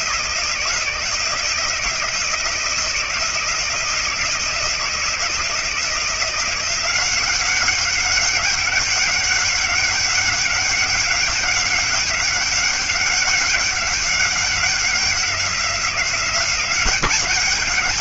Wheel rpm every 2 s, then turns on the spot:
170, 170, 170, 180, 190, 200, 190, 190, 190.
none